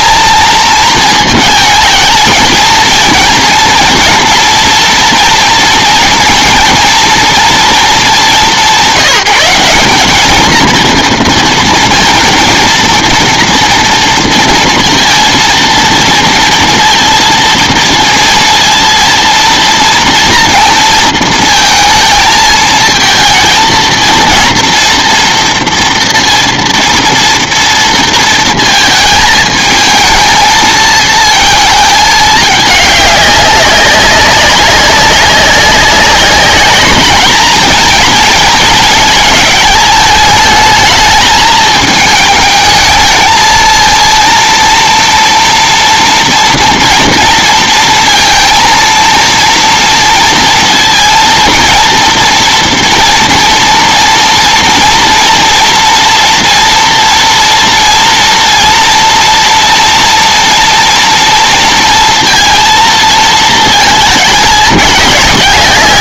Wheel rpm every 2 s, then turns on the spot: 220, 220, 230, 230, 190, 230, 230, 230, 230, 230, 230, 230, 230, 230, 220, 220, 210, 200, 210, 220, 220, 220, 230, 240, 230, 230, 230, 230, 230, 230, 230, 230, 210.
none